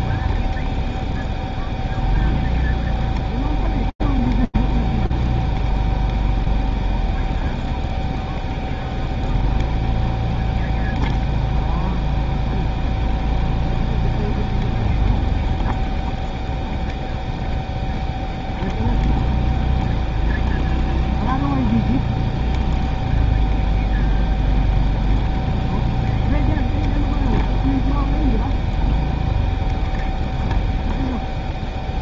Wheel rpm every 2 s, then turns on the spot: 0, 0, 0, 0, 0, 0, 0, 0, 0, 0, 0, 0, 0, 0, 0, 0.
none